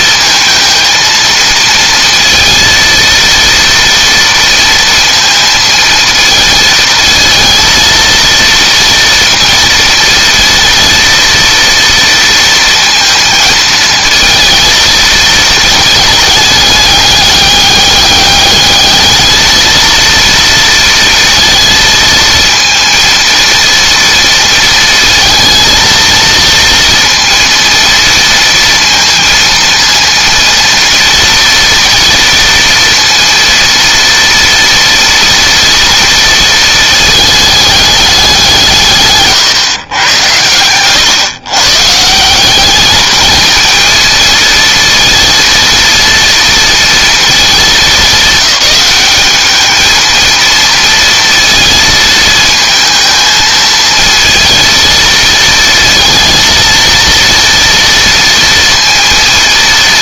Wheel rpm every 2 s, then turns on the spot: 230, 230, 230, 230, 230, 230, 230, 230, 210, 210, 230, 230, 230, 230, 230, 230, 230, 230, 220, 170, 110, 210, 230, 230, 210, 230, 220, 230, 230, 230.
none